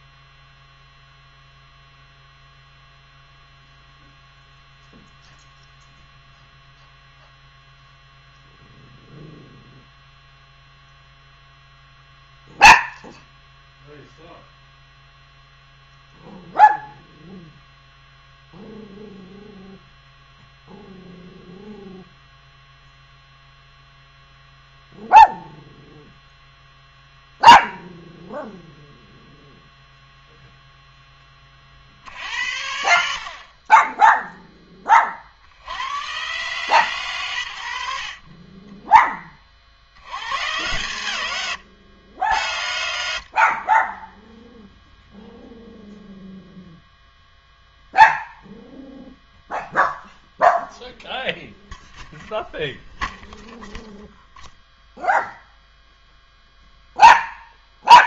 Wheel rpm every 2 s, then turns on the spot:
0, 0, 0, 0, 0, 0, 0, 0, 0, 0, 0, 0, 0, 0, 0, 0, 80, 20, 130, 10, 150, 80, 0, 0, 0, 0, 0, 0, 0.
none